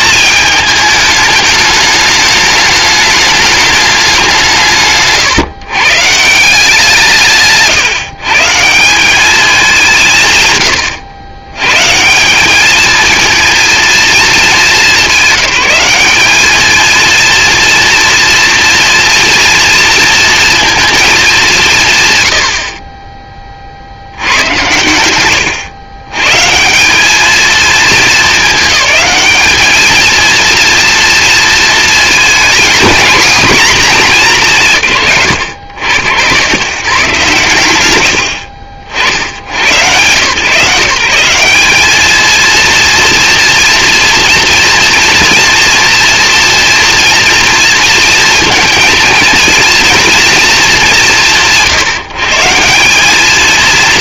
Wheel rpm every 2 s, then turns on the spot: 220, 210, 150, 170, 170, 110, 220, 200, 220, 230, 230, 60, 120, 170, 210, 230, 230, 180, 140, 60, 160, 230, 240, 230, 230, 190, 180.
none